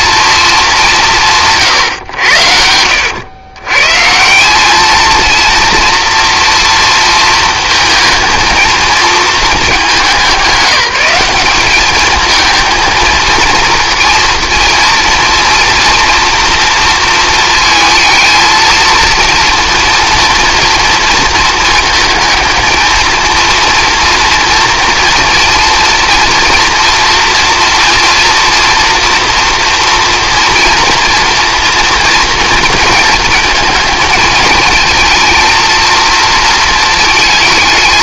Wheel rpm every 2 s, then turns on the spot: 190, 80, 210, 230, 230, 200, 220, 230, 230, 230, 230, 220, 230, 230, 230, 240, 230, 220, 220.
none